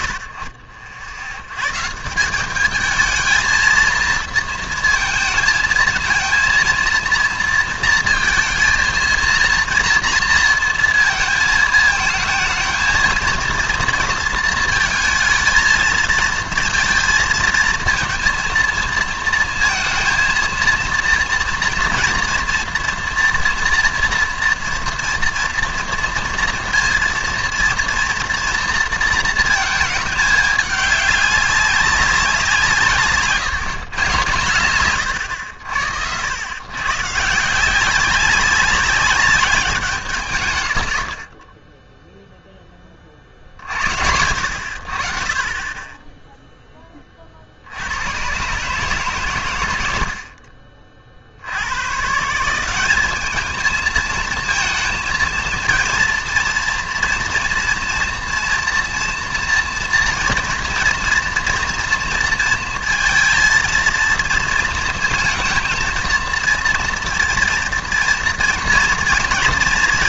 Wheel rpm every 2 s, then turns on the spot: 90, 200, 230, 230, 230, 230, 220, 220, 230, 230, 230, 230, 230, 230, 230, 210, 160, 120, 110, 200, 110, 20, 60, 10, 130, 40, 190, 230, 230, 230, 230, 230, 230, 230, 230.
none